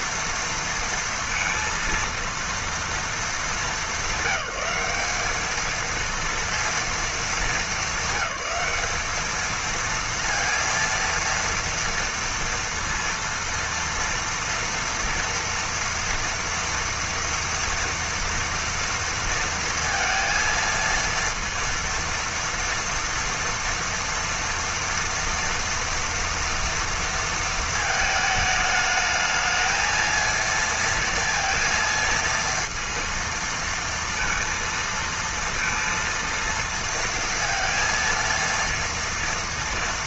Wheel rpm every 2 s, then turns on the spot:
230, 230, 210, 230, 200, 230, 230, 230, 230, 230, 230, 230, 230, 230, 220, 230, 230, 230, 230, 230.
none